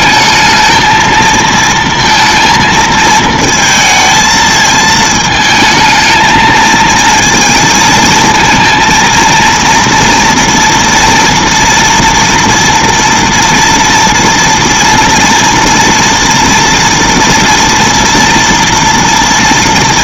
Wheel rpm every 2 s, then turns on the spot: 220, 230, 220, 230, 220, 230, 230, 230, 230, 230.
none